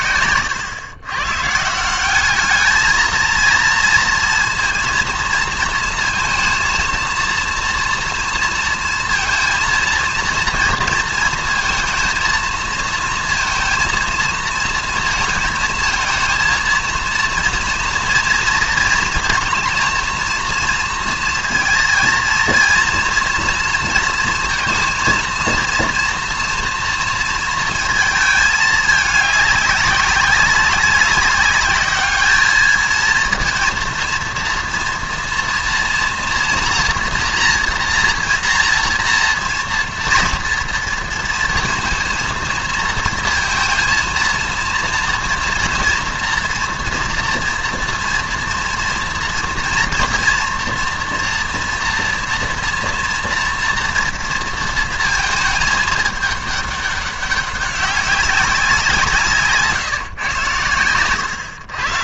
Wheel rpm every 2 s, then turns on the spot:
110, 210, 230, 230, 230, 230, 220, 230, 230, 230, 240, 230, 220, 230, 210, 200, 220, 230, 230, 230, 230, 230, 230, 230, 230, 230, 230, 230, 210, 190, 120.
0-2